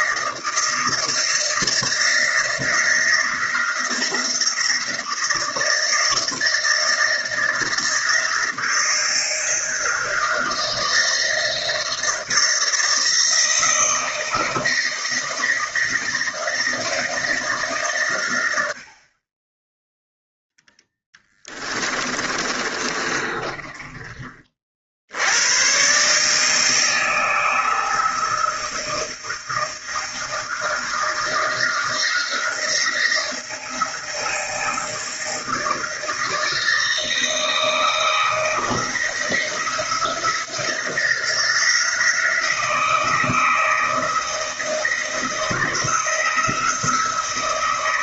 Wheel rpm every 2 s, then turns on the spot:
160, 160, 160, 160, 170, 160, 160, 160, 160, 60, 10, 30, 60, 160, 160, 160, 170, 160, 160, 160, 170, 160, 160, 160.
20-24